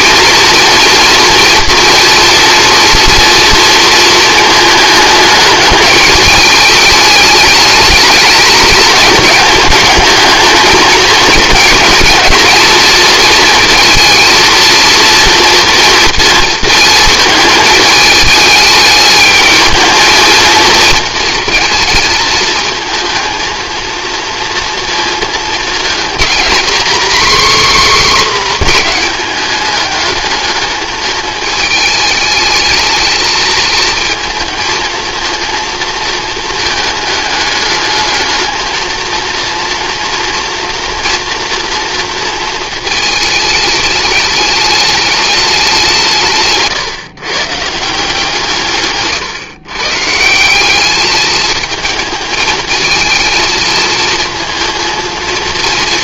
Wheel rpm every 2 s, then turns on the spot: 230, 230, 210, 210, 210, 220, 230, 230, 230, 210, 230, 220, 230, 260, 240, 220, 220, 230, 220, 230, 240, 220, 210, 140, 140, 200, 220, 230.
none